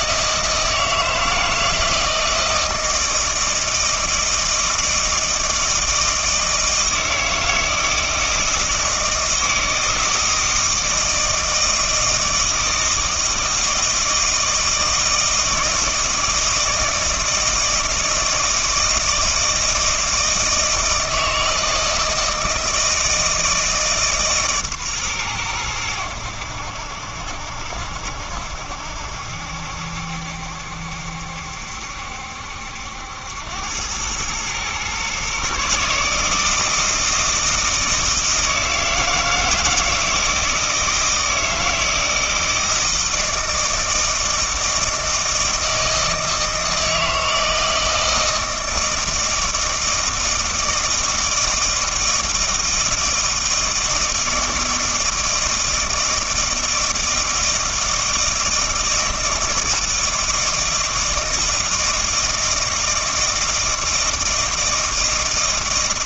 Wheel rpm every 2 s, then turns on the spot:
160, 160, 160, 160, 160, 160, 160, 160, 160, 160, 160, 160, 130, 70, 70, 70, 80, 120, 160, 160, 160, 160, 160, 160, 160, 160, 160, 160, 160, 160, 160, 160, 160.
none